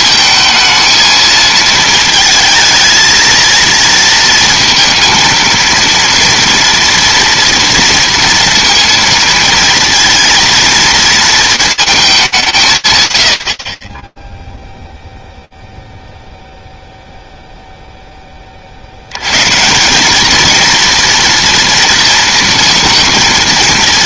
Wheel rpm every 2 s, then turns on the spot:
220, 220, 230, 230, 230, 230, 150, 0, 0, 80, 230, 230.
none